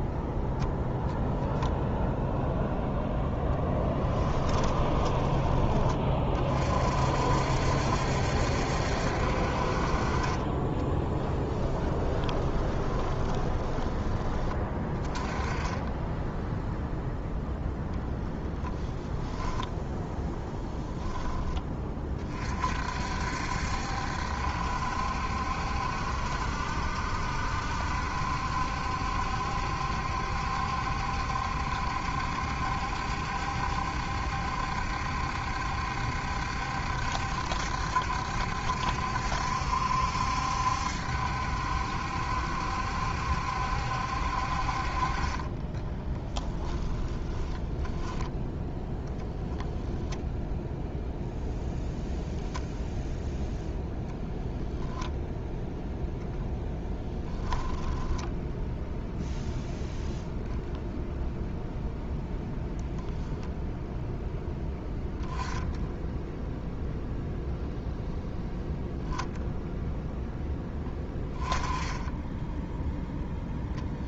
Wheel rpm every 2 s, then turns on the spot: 0, 0, 10, 40, 70, 30, 20, 20, 0, 20, 10, 50, 70, 70, 70, 70, 70, 70, 70, 70, 70, 70, 40, 10, 10, 0, 0, 0, 0, 0, 0, 0, 0, 0, 0, 10, 0.
4-6 10-14 18-20 46-48